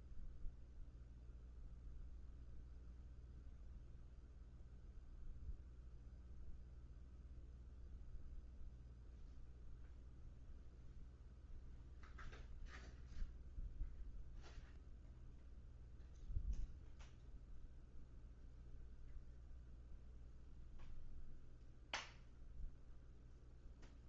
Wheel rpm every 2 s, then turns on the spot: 0, 0, 0, 0, 0, 0, 0, 0, 0, 0, 0, 0.
none